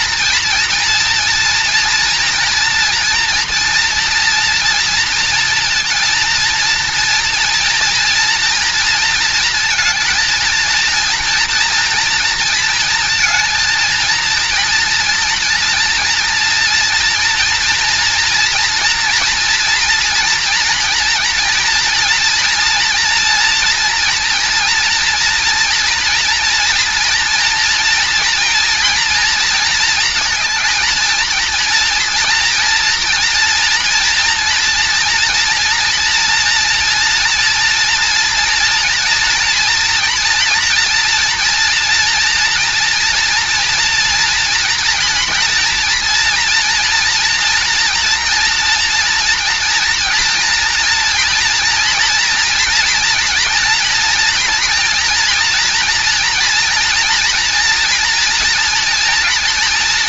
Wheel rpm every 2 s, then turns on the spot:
230, 230, 230, 230, 230, 230, 230, 230, 230, 230, 230, 230, 230, 230, 230, 220, 230, 230, 230, 230, 240, 230, 240, 230, 230, 240, 230, 240, 230, 230.
none